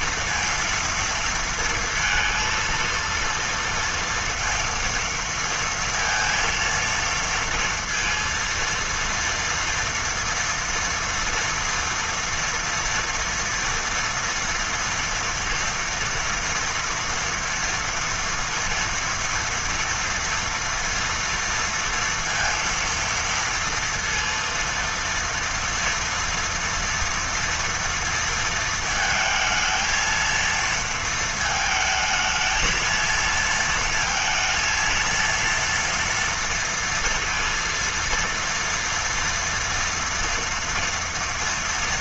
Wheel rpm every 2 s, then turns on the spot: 230, 230, 230, 230, 230, 230, 230, 230, 240, 230, 230, 230, 230, 230, 230, 230, 220, 230, 230, 230, 230.
none